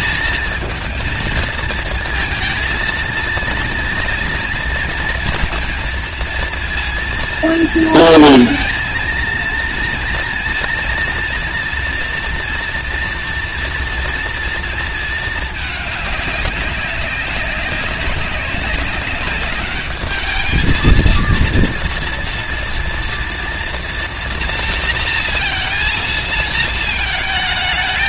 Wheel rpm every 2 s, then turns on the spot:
220, 230, 230, 230, 220, 230, 230, 230, 200, 200, 220, 230, 230, 220.
none